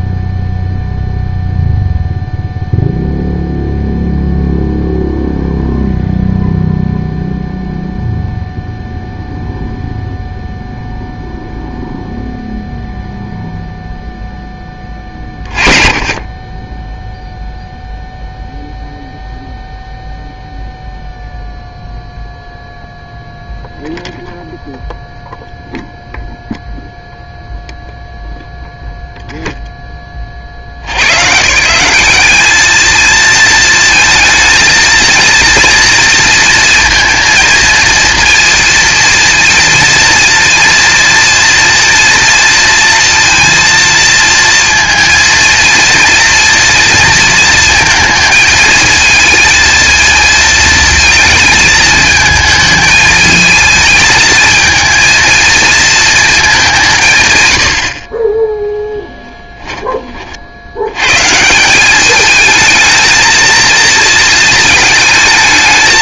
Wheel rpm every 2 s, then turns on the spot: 0, 0, 0, 0, 0, 0, 0, 10, 20, 0, 0, 0, 0, 0, 0, 80, 210, 220, 230, 230, 230, 230, 230, 230, 220, 220, 220, 220, 200, 0, 70, 220, 230.
none